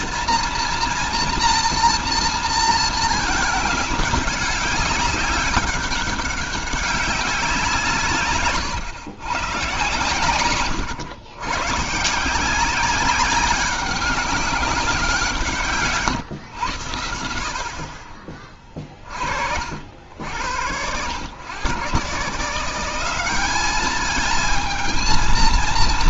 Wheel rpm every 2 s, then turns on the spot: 230, 230, 200, 190, 130, 120, 190, 190, 110, 30, 100, 180, 220.
none